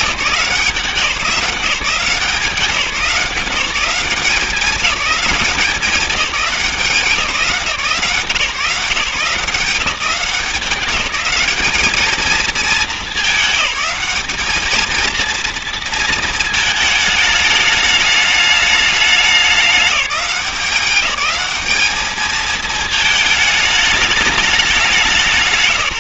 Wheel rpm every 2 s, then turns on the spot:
170, 170, 200, 180, 160, 190, 220, 220, 220, 210, 190, 220, 200.
none